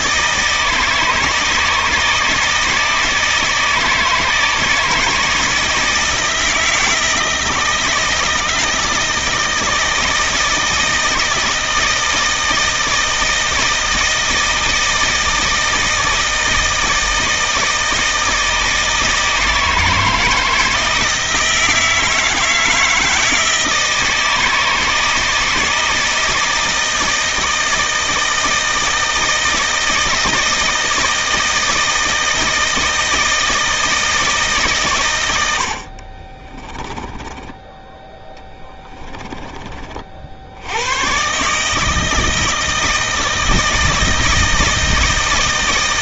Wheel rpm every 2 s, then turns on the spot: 160, 160, 160, 160, 160, 160, 160, 160, 160, 160, 160, 160, 160, 160, 160, 160, 160, 140, 20, 20, 100, 160, 160.
36-40